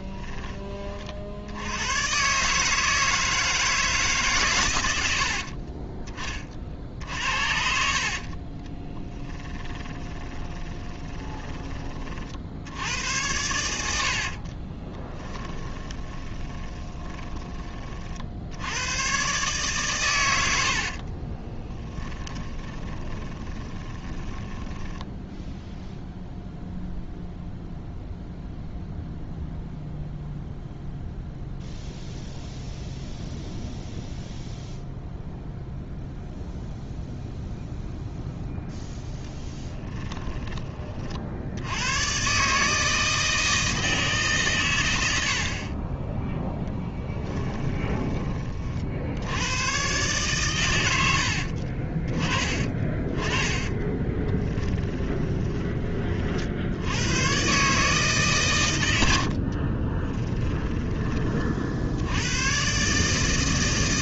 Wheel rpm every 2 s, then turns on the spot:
30, 150, 100, 50, 40, 20, 90, 30, 30, 100, 50, 20, 20, 0, 0, 0, 0, 0, 0, 0, 30, 160, 110, 10, 50, 100, 30, 20, 90, 100, 20, 140.
8-12 14-18 20-26 46-48 52-56